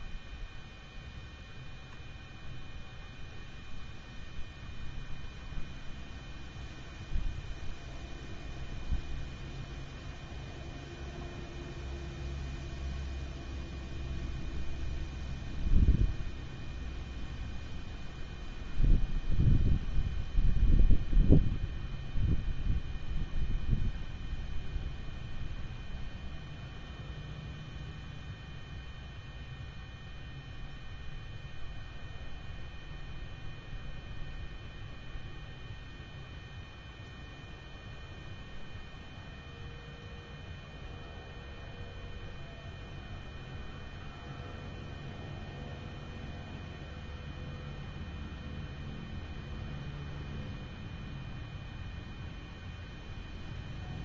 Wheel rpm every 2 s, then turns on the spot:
0, 0, 0, 0, 0, 0, 0, 0, 0, 0, 0, 0, 0, 0, 0, 0, 0, 0, 0, 0, 0, 0, 0, 0, 0, 0, 0.
none